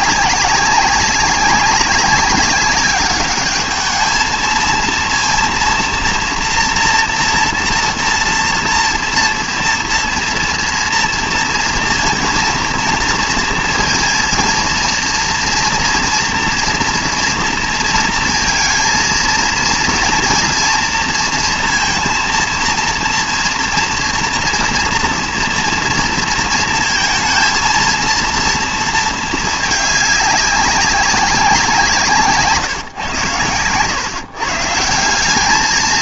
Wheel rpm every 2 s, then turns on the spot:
190, 200, 230, 240, 230, 230, 230, 230, 230, 230, 240, 240, 240, 220, 230, 200, 140, 140.
none